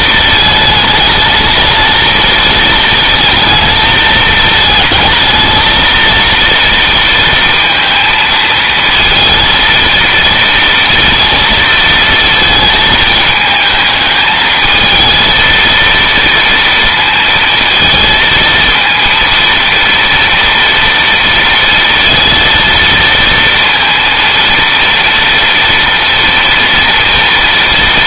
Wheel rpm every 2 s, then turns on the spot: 220, 220, 220, 230, 220, 230, 220, 220, 230, 230, 230, 230, 230, 230.
none